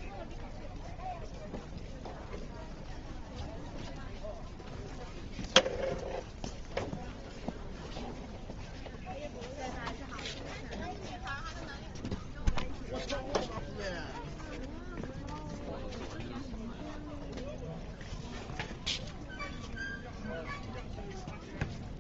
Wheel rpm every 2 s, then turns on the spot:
0, 0, 0, 0, 0, 0, 0, 0, 0, 0, 0.
none